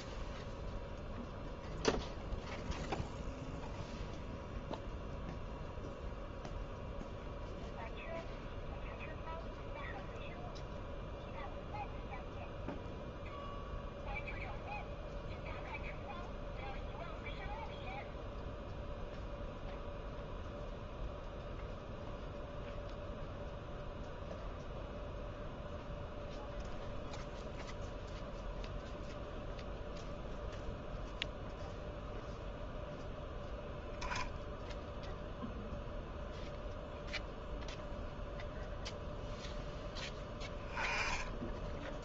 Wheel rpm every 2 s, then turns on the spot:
0, 0, 0, 0, 0, 0, 0, 0, 0, 0, 0, 0, 0, 0, 0, 0, 0, 0, 0, 0, 10.
none